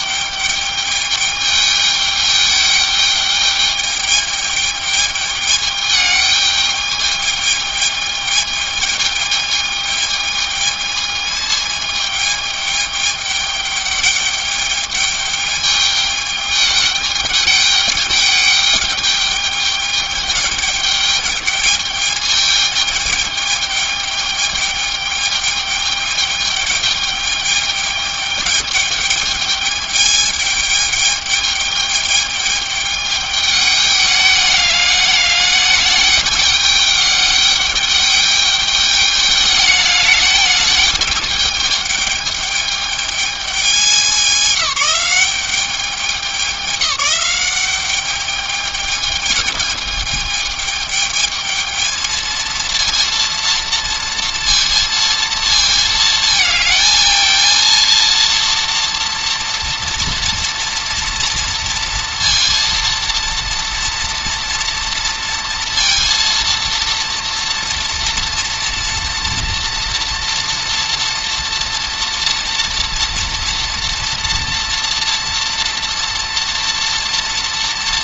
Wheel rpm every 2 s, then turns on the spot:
210, 210, 210, 210, 210, 220, 210, 210, 210, 210, 210, 210, 210, 210, 210, 210, 210, 210, 210, 210, 210, 210, 190, 200, 210, 220, 230, 230, 220, 240, 230, 230, 230, 230, 230, 240, 230, 230, 230.
none